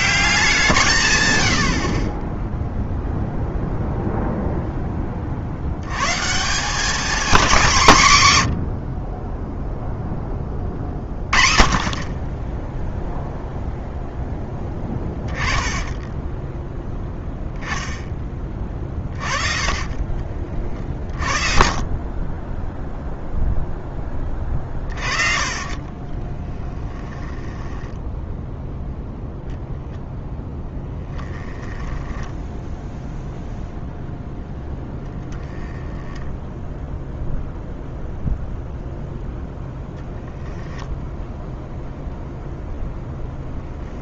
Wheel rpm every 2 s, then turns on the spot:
170, 20, 0, 170, 110, 20, 20, 10, 10, 20, 30, 30, 30, 10, 0, 10, 0, 20, 0, 0, 0, 0.
14-16 24-28 30-32 34-36